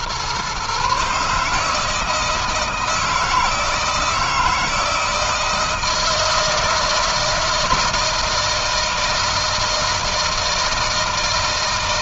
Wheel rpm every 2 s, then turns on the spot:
130, 160, 160, 160, 160, 160.
none